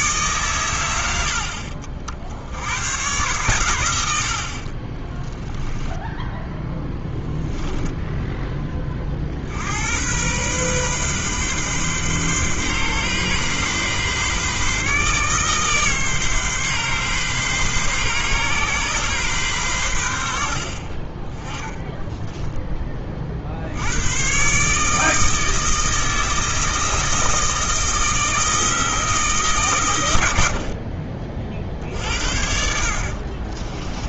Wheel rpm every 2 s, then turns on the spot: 110, 100, 40, 10, 20, 130, 130, 140, 130, 130, 50, 10, 150, 160, 160, 60, 60.
6-8 20-22 30-32